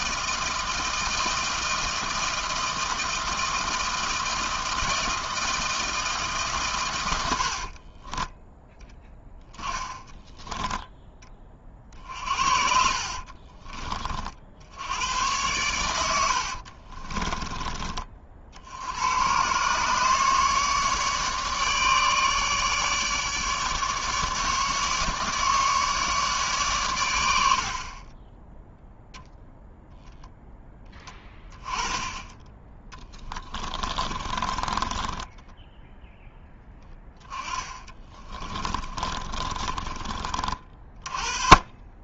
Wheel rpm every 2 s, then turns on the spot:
160, 160, 160, 110, 10, 10, 60, 90, 40, 90, 150, 150, 150, 110, 0, 10, 20, 20, 10, 20, 30.
12-14 16-18 32-40